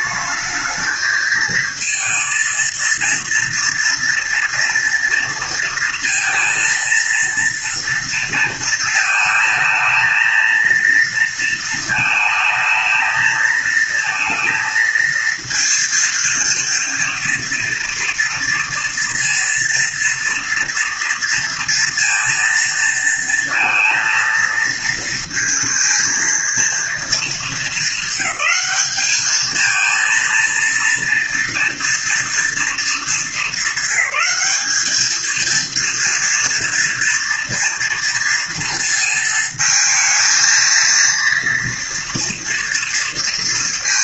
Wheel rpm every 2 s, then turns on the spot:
220, 230, 230, 230, 230, 220, 220, 220, 230, 230, 230, 230, 230, 230, 200, 230, 240, 210, 230, 230, 220, 230.
none